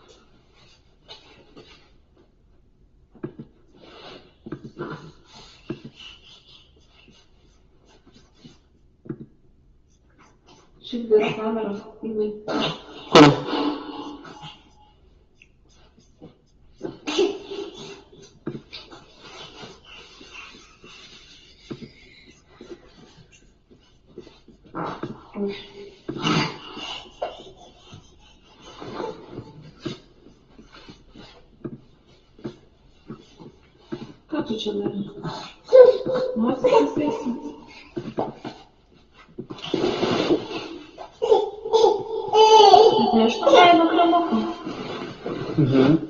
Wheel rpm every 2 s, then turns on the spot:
0, 0, 0, 0, 0, 0, 0, 0, 0, 0, 0, 0, 0, 0, 0, 0, 0, 0, 0, 0, 0, 0, 0.
none